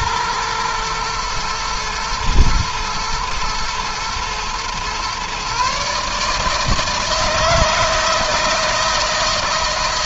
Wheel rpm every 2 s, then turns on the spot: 120, 110, 120, 160, 160.
none